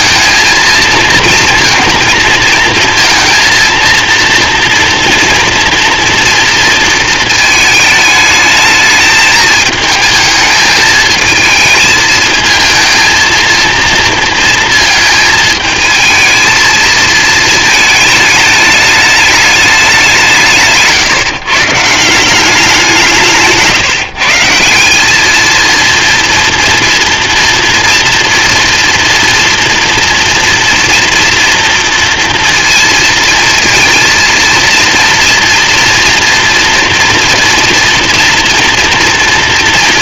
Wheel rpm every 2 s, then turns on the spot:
230, 230, 230, 230, 220, 220, 220, 230, 220, 210, 150, 180, 180, 240, 240, 240, 230, 230, 240, 230.
none